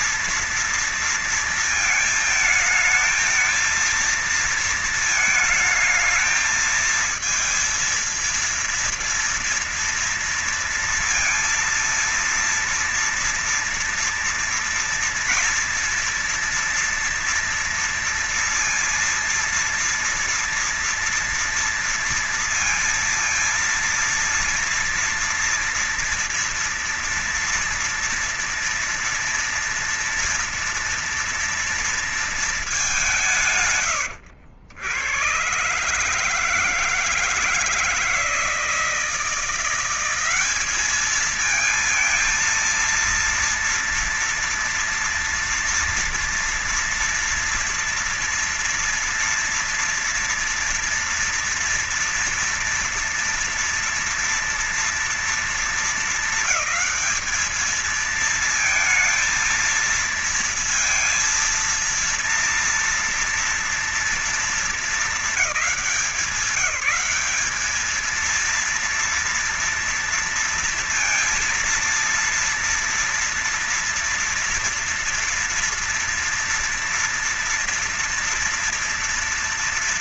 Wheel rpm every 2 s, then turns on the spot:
230, 220, 230, 220, 230, 230, 230, 230, 230, 230, 230, 230, 230, 240, 230, 230, 230, 80, 150, 160, 180, 230, 230, 230, 230, 230, 230, 230, 210, 220, 230, 230, 220, 180, 220, 230, 230, 230, 230, 230.
none